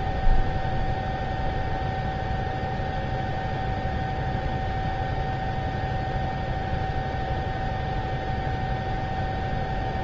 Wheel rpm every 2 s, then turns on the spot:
0, 0, 0, 0, 0.
none